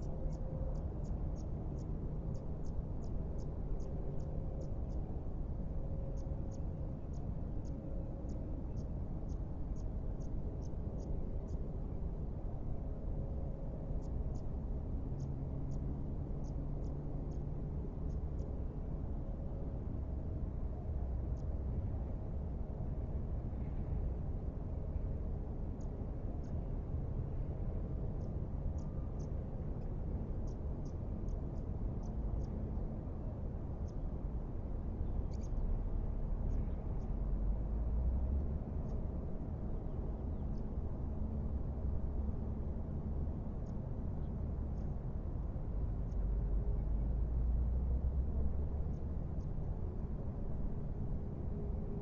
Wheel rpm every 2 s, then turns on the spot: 0, 0, 0, 0, 0, 0, 0, 0, 0, 0, 0, 0, 0, 0, 0, 0, 0, 0, 0, 0, 0, 0, 0, 0, 0, 0.
none